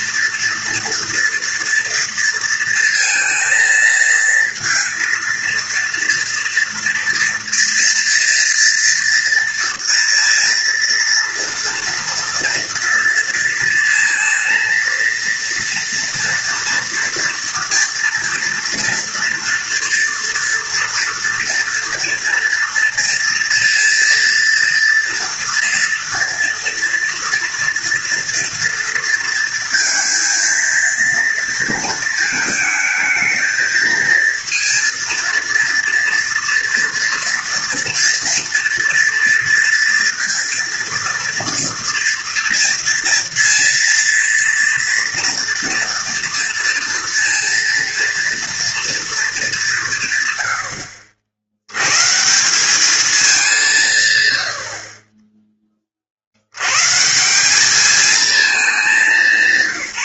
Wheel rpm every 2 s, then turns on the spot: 230, 230, 230, 230, 230, 230, 230, 230, 230, 230, 230, 230, 230, 240, 230, 230, 220, 230, 230, 230, 230, 230, 230, 230, 230, 80, 190, 70, 100, 210.
none